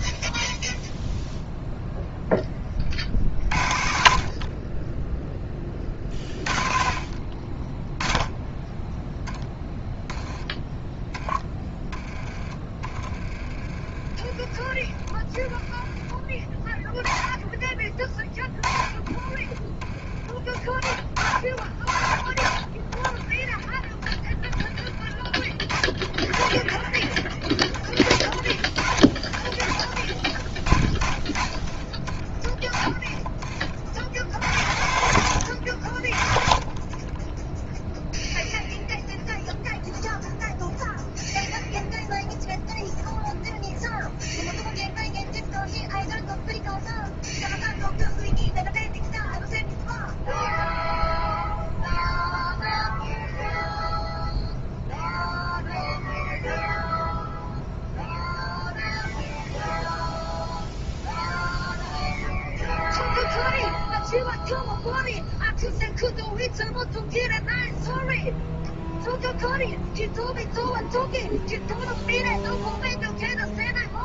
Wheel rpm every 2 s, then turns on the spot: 0, 20, 20, 40, 0, 10, 20, 20, 20, 20, 40, 30, 10, 30, 40, 30, 30, 70, 30, 0, 0, 0, 0, 0, 0, 0, 0, 0, 0, 0, 0, 0, 0, 0, 0, 0, 0.
18-20 22-24